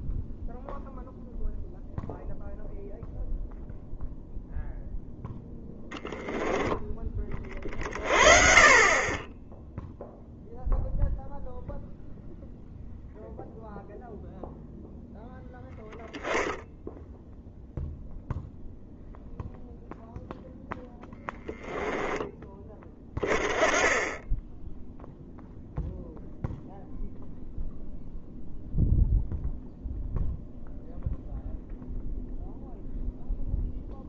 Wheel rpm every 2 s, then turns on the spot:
0, 0, 0, 10, 40, 0, 0, 0, 10, 0, 0, 10, 10, 0, 0, 0, 0.
none